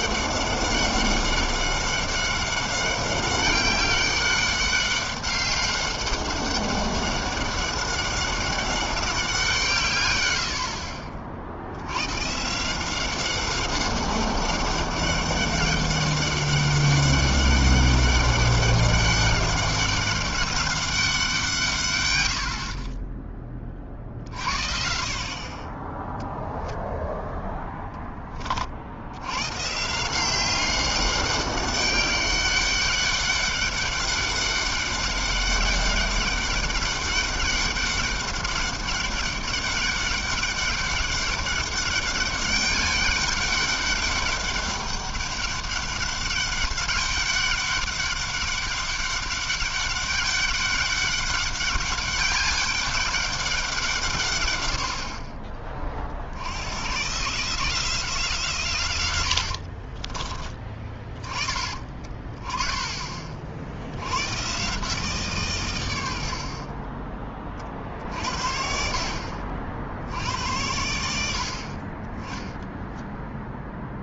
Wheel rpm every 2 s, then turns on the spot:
200, 200, 200, 190, 180, 50, 190, 200, 200, 200, 170, 20, 40, 0, 100, 200, 200, 200, 200, 200, 200, 200, 200, 200, 200, 200, 190, 40, 150, 80, 30, 50, 150, 30, 60, 70, 20.
58-60